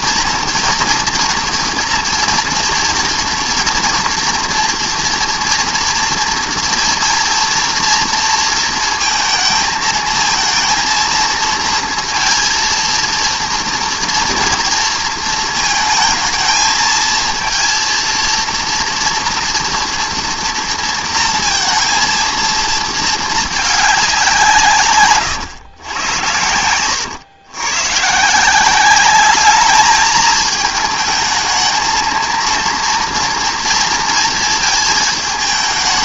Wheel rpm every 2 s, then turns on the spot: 230, 230, 230, 230, 230, 230, 230, 230, 220, 230, 230, 230, 130, 100, 190, 220, 230, 220.
none